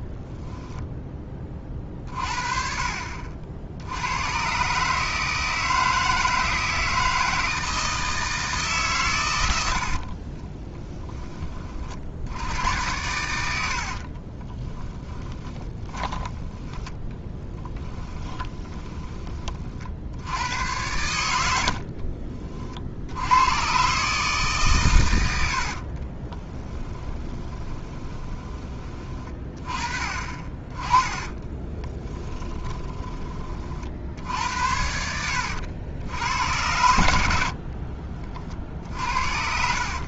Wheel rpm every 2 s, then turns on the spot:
0, 40, 140, 160, 150, 20, 90, 10, 10, 10, 90, 60, 130, 10, 20, 20, 20, 70, 100, 50.
10-12 14-20 26-28 32-34